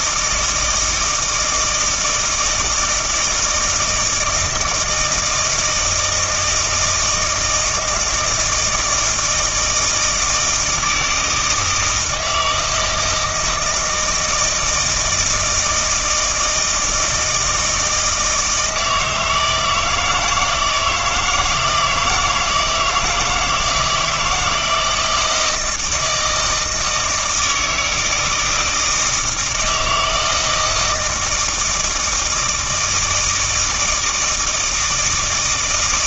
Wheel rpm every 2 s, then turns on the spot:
160, 160, 160, 160, 160, 160, 160, 160, 160, 160, 160, 160, 170, 160, 160, 160, 160, 160.
none